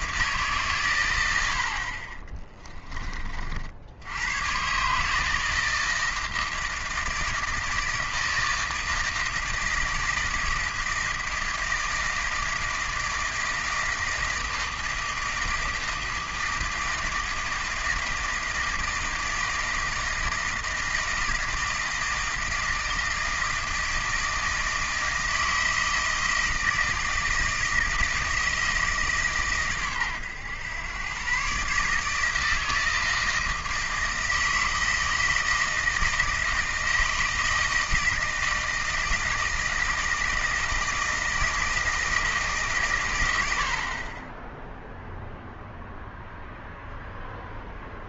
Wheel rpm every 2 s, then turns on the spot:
140, 20, 130, 160, 160, 160, 160, 160, 160, 160, 160, 160, 160, 160, 160, 110, 160, 160, 160, 160, 160, 140, 0, 0.
none